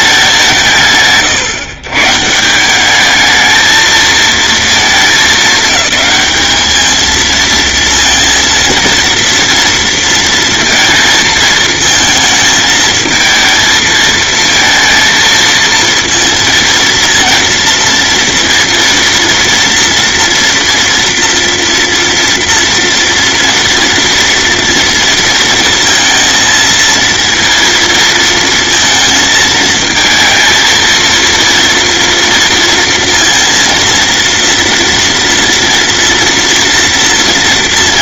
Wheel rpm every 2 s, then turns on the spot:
140, 220, 210, 230, 230, 230, 220, 230, 230, 230, 230, 230, 230, 230, 220, 230, 230, 230, 230.
none